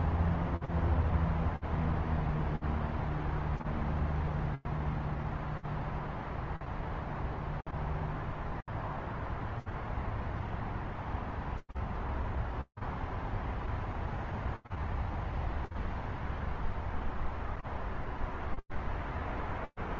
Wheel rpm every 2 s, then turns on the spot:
0, 0, 0, 0, 0, 0, 0, 0, 0, 0.
none